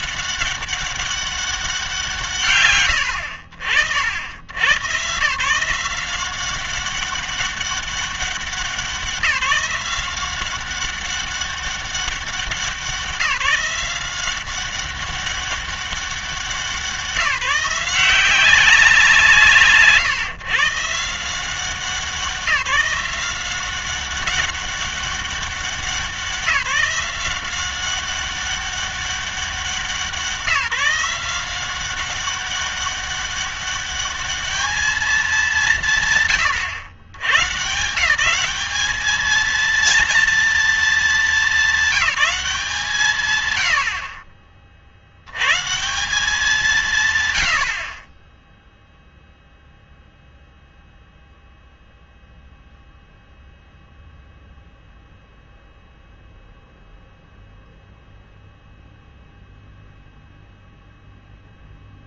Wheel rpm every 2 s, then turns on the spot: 190, 120, 110, 190, 190, 190, 180, 190, 180, 180, 130, 180, 200, 180, 200, 170, 200, 220, 120, 200, 230, 180, 40, 170, 0, 0, 0, 0, 0, 0, 0.
none